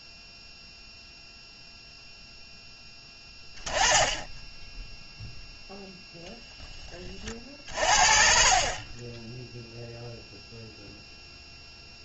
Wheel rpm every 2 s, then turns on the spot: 0, 10, 10, 10, 50, 0.
none